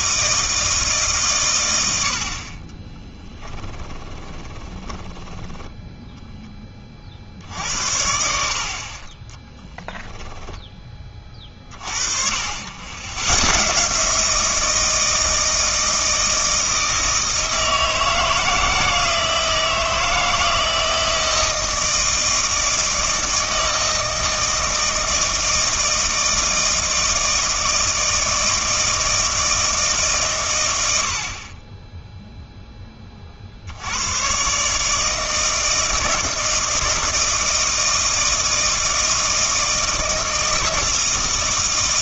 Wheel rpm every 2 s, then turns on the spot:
160, 40, 20, 20, 60, 10, 70, 160, 160, 160, 160, 160, 160, 160, 160, 110, 10, 140, 160, 160, 160.
2-6 10-12